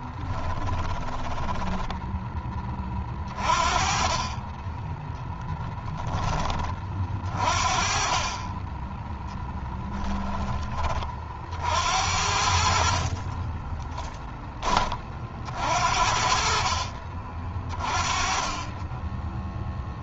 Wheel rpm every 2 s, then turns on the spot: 20, 20, 20, 40, 10, 30, 50, 30, 40, 10.
0-2 4-6 12-14